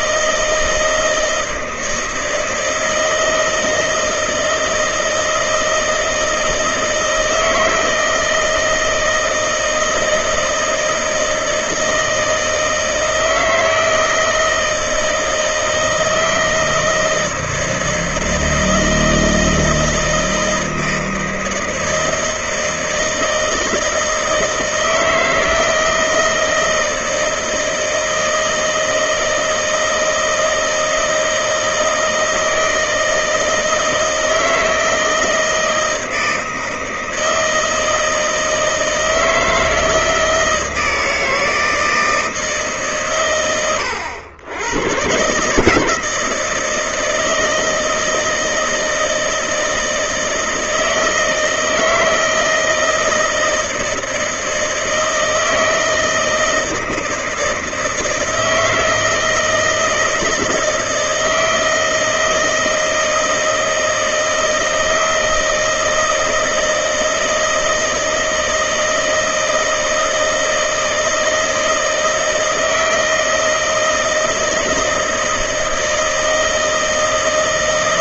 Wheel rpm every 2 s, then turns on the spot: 160, 160, 160, 160, 160, 160, 160, 160, 160, 160, 160, 160, 160, 160, 160, 160, 160, 160, 160, 160, 160, 150, 100, 160, 160, 160, 160, 160, 160, 160, 160, 160, 160, 160, 160, 160, 160, 160, 160.
none